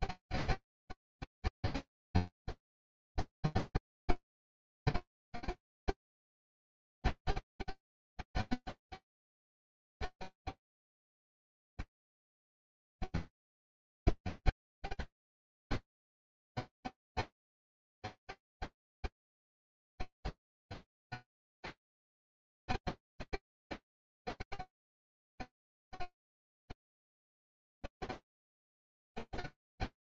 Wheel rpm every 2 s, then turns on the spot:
0, 0, 0, 0, 0, 0, 0, 0, 0, 0, 0, 0, 0, 0, 0.
none